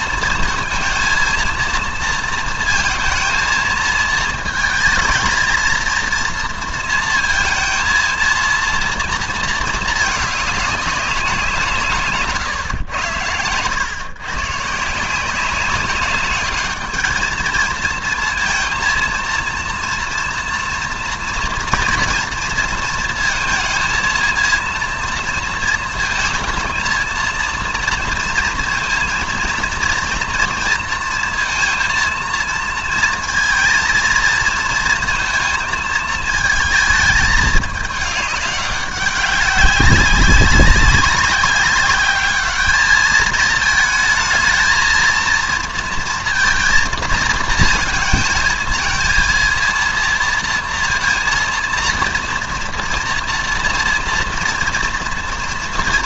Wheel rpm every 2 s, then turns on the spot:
230, 230, 220, 230, 230, 200, 130, 150, 210, 230, 240, 230, 230, 220, 230, 230, 230, 230, 220, 200, 190, 210, 220, 230, 230, 230, 240, 230.
none